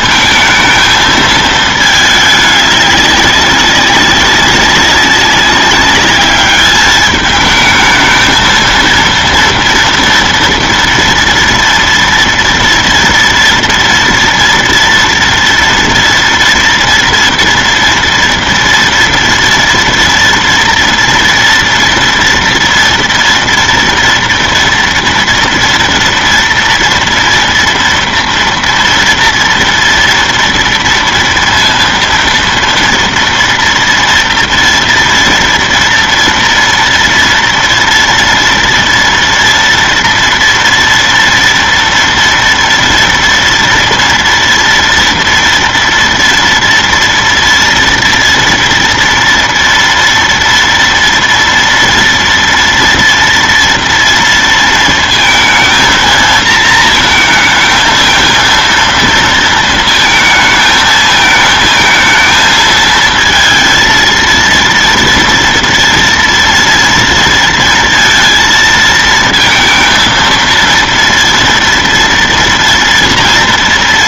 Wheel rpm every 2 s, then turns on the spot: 230, 210, 190, 210, 220, 230, 230, 230, 230, 230, 230, 240, 230, 230, 230, 230, 240, 230, 230, 230, 230, 230, 230, 230, 230, 230, 230, 230, 230, 230, 220, 220, 230, 230, 230, 230, 230.
none